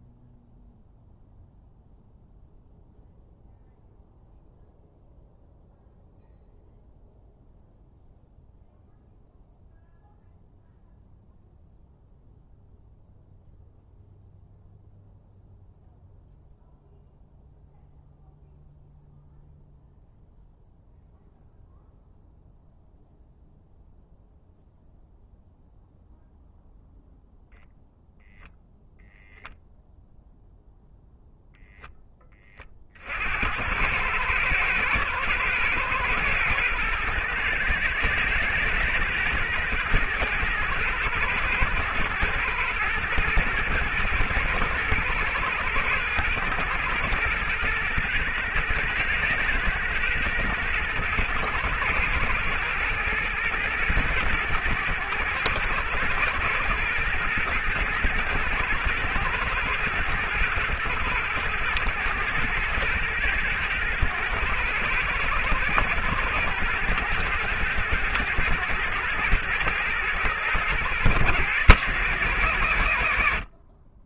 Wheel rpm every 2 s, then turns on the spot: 0, 0, 0, 0, 0, 0, 0, 0, 0, 0, 0, 0, 0, 0, 0, 0, 40, 110, 110, 110, 110, 110, 110, 110, 120, 110, 110, 110, 110, 110, 110, 110, 110, 110, 110, 110, 90.
none